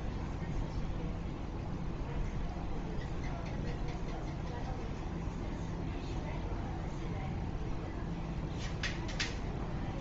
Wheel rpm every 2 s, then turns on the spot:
0, 0, 0, 0, 0.
none